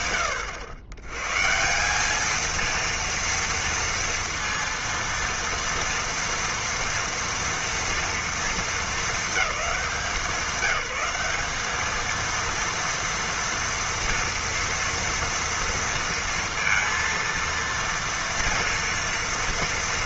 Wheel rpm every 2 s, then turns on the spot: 110, 230, 230, 230, 210, 200, 230, 230, 230, 230.
none